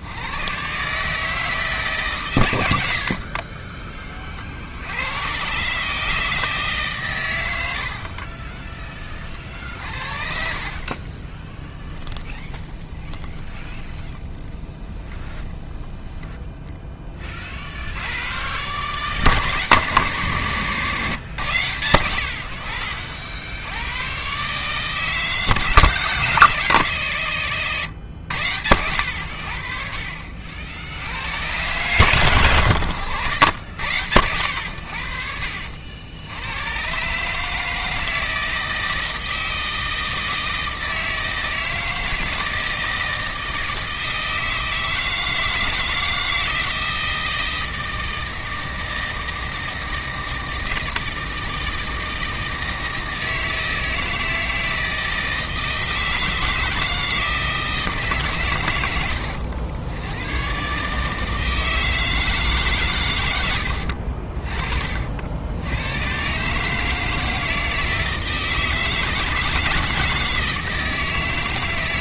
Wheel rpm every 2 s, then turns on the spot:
120, 100, 60, 150, 30, 50, 20, 10, 10, 130, 130, 70, 140, 150, 100, 60, 110, 80, 100, 160, 160, 160, 160, 160, 160, 160, 160, 160, 160, 120, 140, 140, 40, 150, 160, 160.
8-16